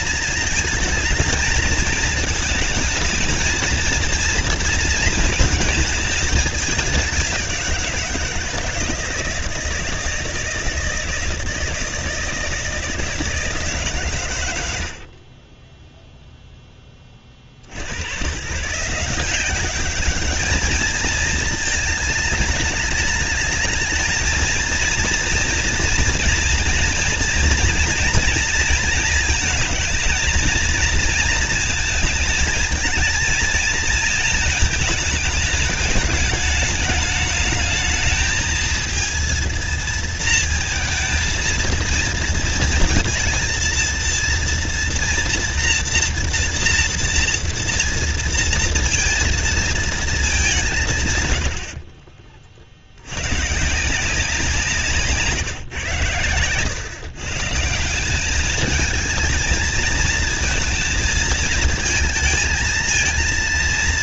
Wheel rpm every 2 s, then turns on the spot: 220, 220, 230, 210, 170, 160, 160, 110, 0, 130, 210, 220, 220, 230, 230, 230, 230, 220, 220, 220, 230, 230, 230, 230, 230, 200, 50, 170, 110, 210, 220, 220.
none